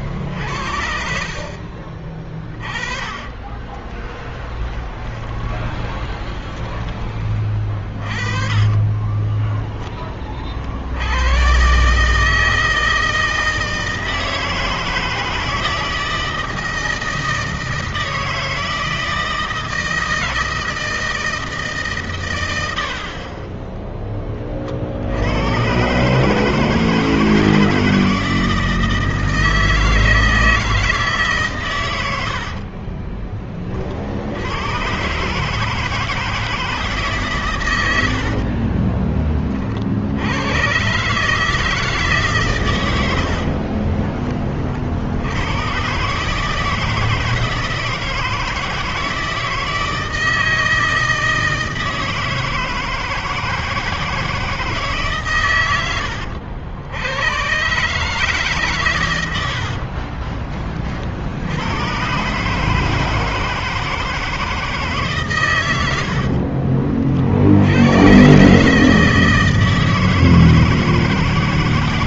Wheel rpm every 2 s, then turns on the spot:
60, 30, 20, 10, 30, 40, 160, 160, 160, 160, 160, 100, 40, 150, 160, 160, 60, 90, 160, 50, 100, 130, 30, 150, 160, 160, 160, 160, 80, 140, 30, 140, 160, 50, 130, 160.
2-6 8-10 32-34 38-40 66-68